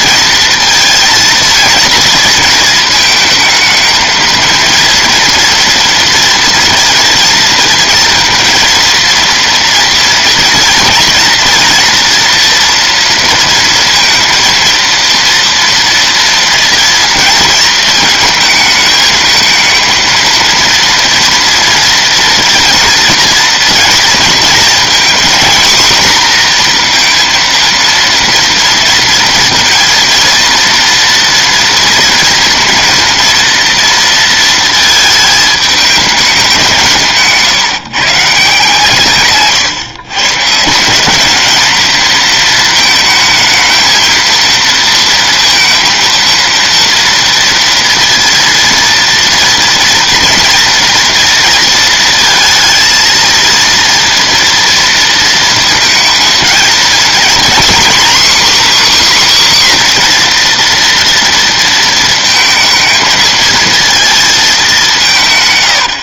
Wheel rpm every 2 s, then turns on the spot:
230, 220, 230, 230, 230, 240, 230, 230, 240, 220, 230, 230, 240, 240, 230, 230, 230, 220, 180, 150, 170, 220, 230, 230, 230, 240, 230, 230, 230, 280, 240, 220, 200.
none